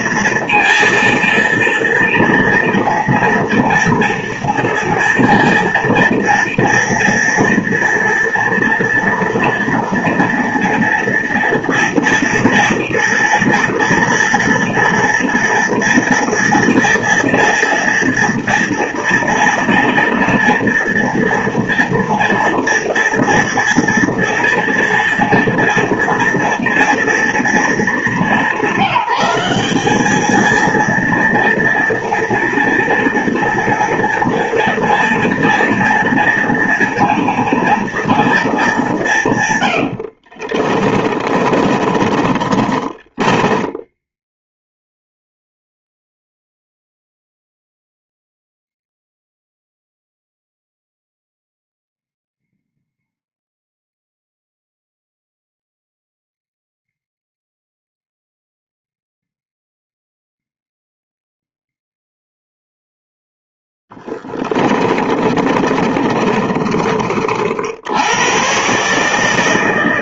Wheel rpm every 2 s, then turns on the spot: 230, 230, 230, 230, 230, 230, 230, 230, 230, 230, 230, 230, 230, 230, 190, 230, 240, 230, 230, 210, 40, 30, 0, 0, 0, 0, 0, 0, 0, 0, 0, 0, 20, 30, 120.
40-44 64-68